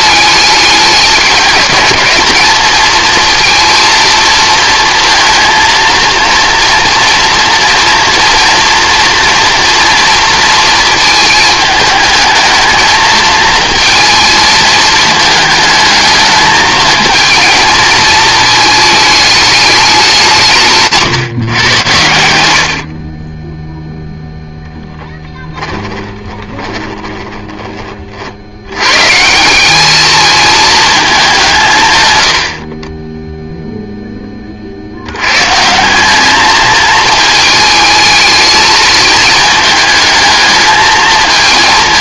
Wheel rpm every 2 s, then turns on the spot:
200, 220, 230, 230, 240, 220, 220, 220, 220, 220, 160, 50, 0, 20, 120, 210, 30, 80, 220, 220, 220.
20-22 26-28